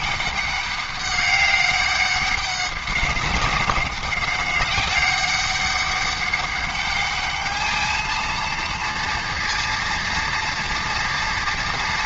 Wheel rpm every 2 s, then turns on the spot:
200, 200, 190, 200, 220, 230.
none